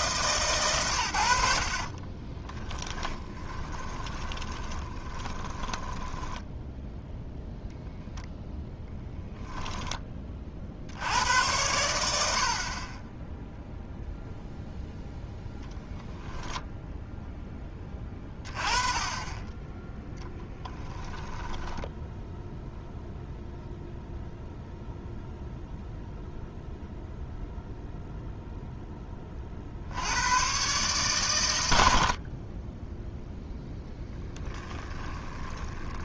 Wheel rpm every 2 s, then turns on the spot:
110, 10, 20, 0, 0, 60, 40, 0, 0, 20, 10, 0, 0, 0, 10, 130, 10, 20.
2-6 20-22 34-36